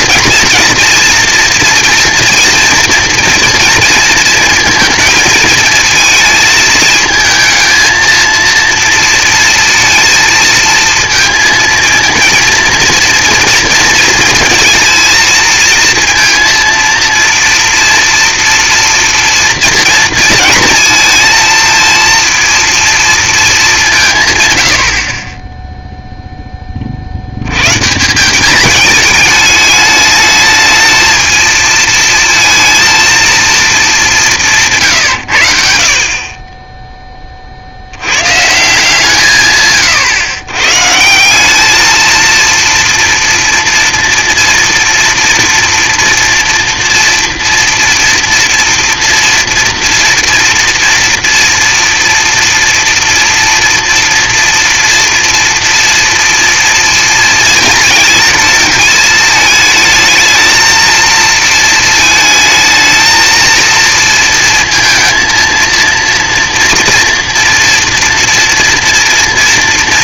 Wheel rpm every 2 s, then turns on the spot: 240, 240, 230, 220, 230, 230, 230, 230, 230, 230, 230, 230, 100, 20, 210, 220, 220, 170, 30, 150, 120, 230, 230, 230, 240, 230, 240, 230, 230, 220, 230, 220, 230, 240, 230.
none